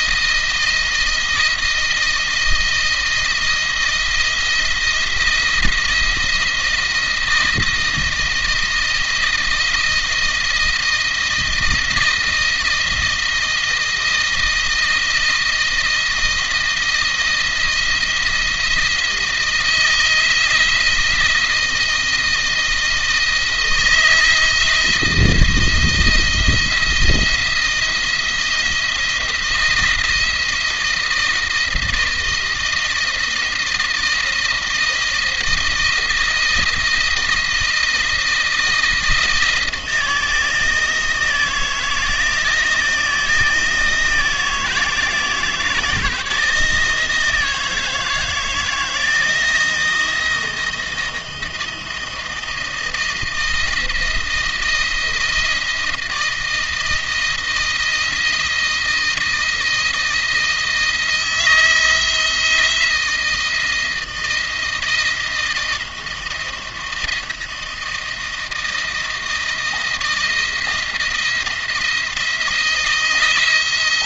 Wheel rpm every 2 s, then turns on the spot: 170, 160, 170, 170, 160, 160, 170, 160, 160, 170, 170, 160, 170, 170, 170, 160, 160, 160, 160, 160, 160, 160, 160, 160, 160, 170, 160, 170, 170, 160, 170, 160, 170, 170, 170, 170, 160.
none